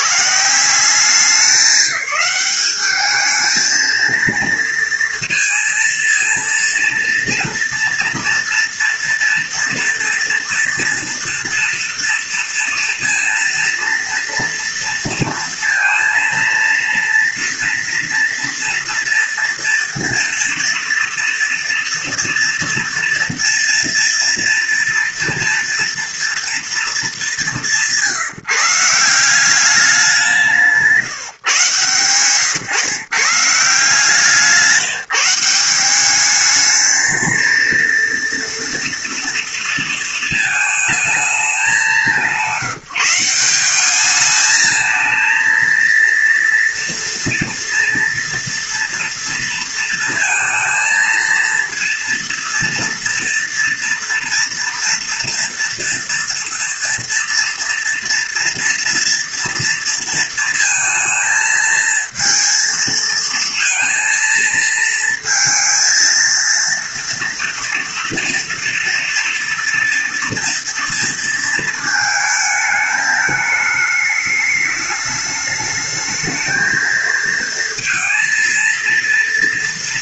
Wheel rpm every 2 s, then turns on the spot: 170, 200, 230, 230, 230, 230, 230, 230, 230, 230, 230, 230, 230, 220, 160, 160, 130, 170, 220, 230, 220, 170, 220, 230, 230, 230, 230, 230, 230, 230, 230, 230, 220, 230, 230, 230, 220, 210, 230, 230.
none